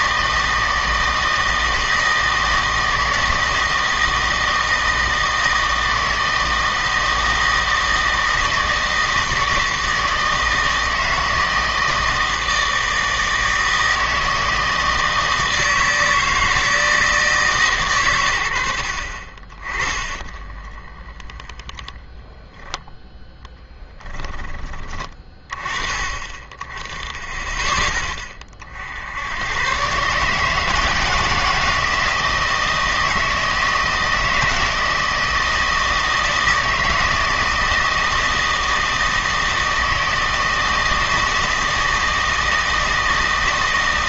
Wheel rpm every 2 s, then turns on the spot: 160, 160, 160, 160, 160, 160, 160, 160, 160, 70, 30, 0, 20, 20, 60, 160, 160, 160, 160, 160, 160, 160.
20-22